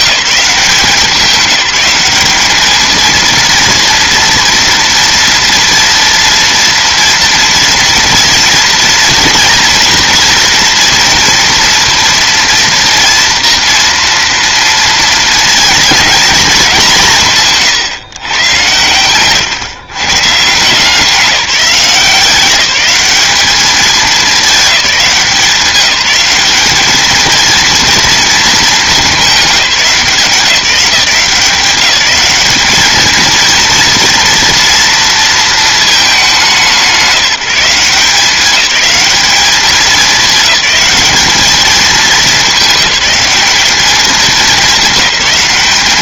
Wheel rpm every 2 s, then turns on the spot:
180, 210, 230, 230, 230, 230, 230, 230, 200, 120, 170, 190, 200, 210, 220, 180, 220, 230, 200, 200, 210, 210, 200.
none